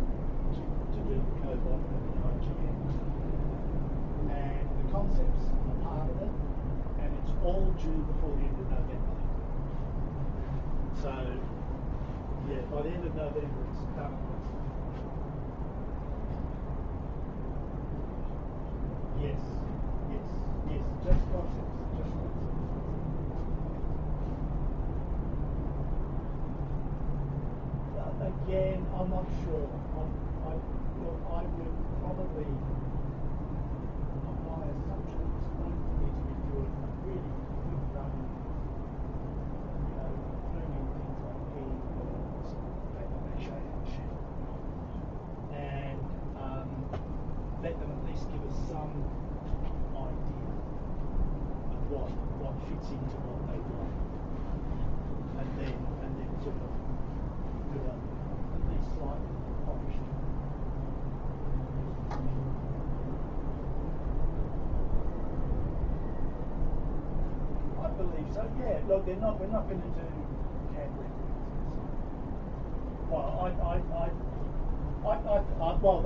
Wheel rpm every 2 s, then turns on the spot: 0, 0, 0, 0, 0, 0, 0, 0, 0, 0, 0, 0, 0, 0, 0, 0, 0, 0, 0, 0, 0, 0, 0, 0, 0, 0, 0, 0, 0, 0, 0, 0, 0, 0, 0, 0, 0, 0.
none